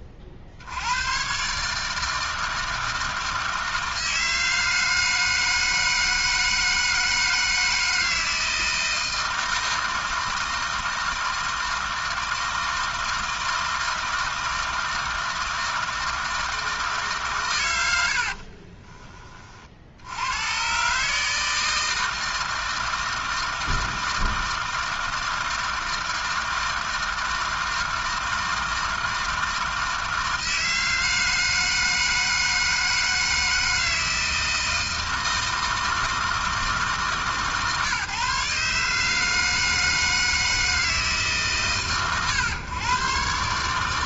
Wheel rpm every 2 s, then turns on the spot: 70, 160, 160, 160, 160, 160, 160, 160, 160, 40, 130, 160, 160, 160, 160, 160, 160, 160, 150, 150, 160, 130.
18-20